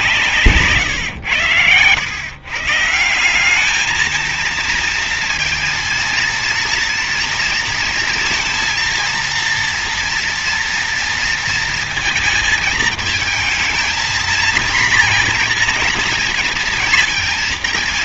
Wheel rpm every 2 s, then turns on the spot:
150, 130, 230, 230, 230, 230, 230, 230, 230.
none